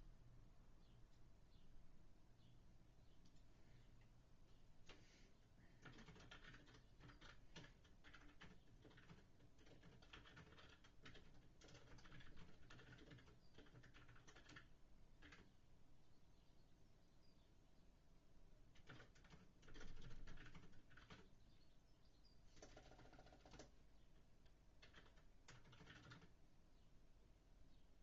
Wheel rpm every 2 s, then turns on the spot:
0, 0, 0, 0, 0, 0, 0, 0, 0, 0, 0, 0, 0, 0.
none